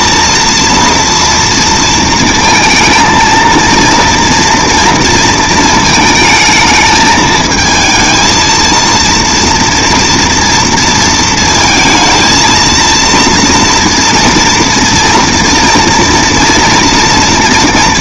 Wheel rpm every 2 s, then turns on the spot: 230, 230, 230, 220, 230, 230, 230, 230, 230.
none